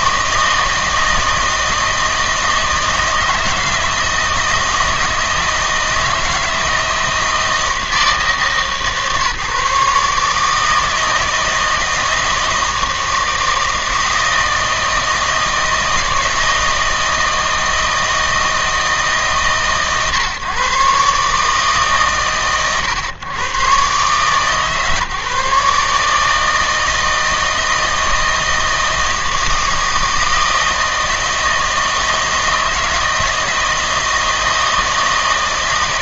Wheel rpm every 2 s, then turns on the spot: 160, 160, 160, 160, 150, 150, 160, 160, 160, 160, 130, 120, 140, 160, 160, 160, 160, 160.
none